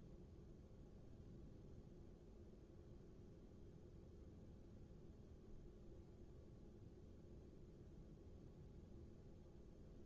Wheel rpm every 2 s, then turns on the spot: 0, 0, 0, 0, 0.
none